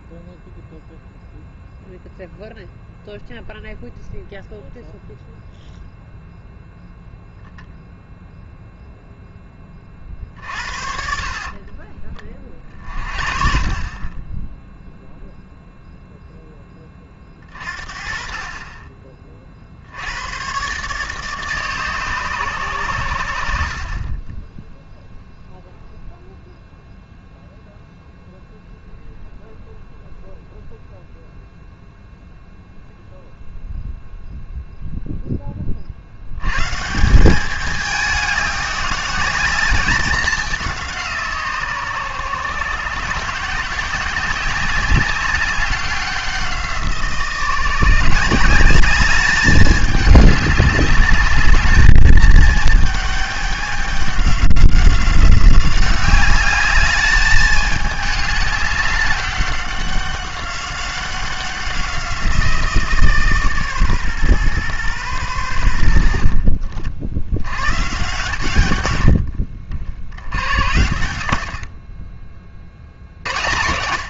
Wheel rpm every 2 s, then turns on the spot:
0, 0, 0, 0, 0, 50, 40, 0, 10, 30, 130, 120, 0, 0, 0, 0, 0, 0, 130, 190, 190, 140, 190, 170, 190, 200, 220, 190, 210, 200, 190, 170, 120, 60, 120, 90, 60.
10-12